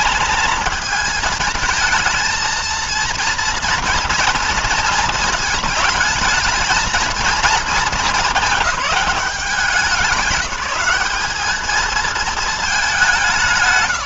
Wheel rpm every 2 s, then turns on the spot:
220, 230, 230, 220, 210, 200, 190.
none